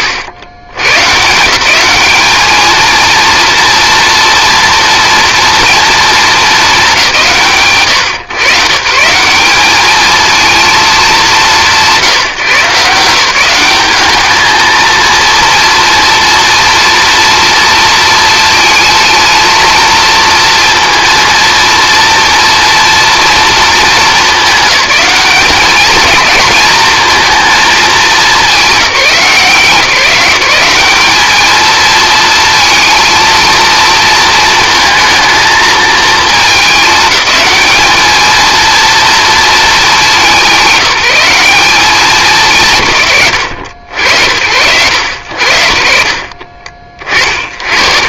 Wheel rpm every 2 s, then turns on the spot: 120, 220, 230, 190, 150, 220, 160, 230, 230, 230, 230, 230, 210, 230, 180, 200, 230, 220, 210, 230, 190, 120, 90, 60.
none